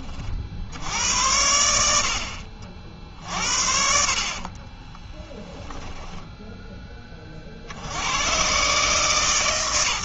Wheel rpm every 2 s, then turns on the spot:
70, 50, 40, 20, 130.
4-8